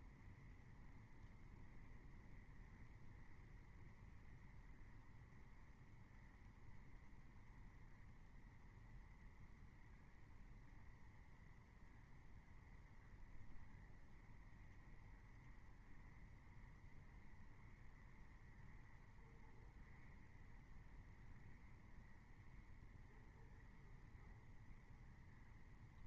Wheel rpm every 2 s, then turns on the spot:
0, 0, 0, 0, 0, 0, 0, 0, 0, 0, 0, 0, 0.
none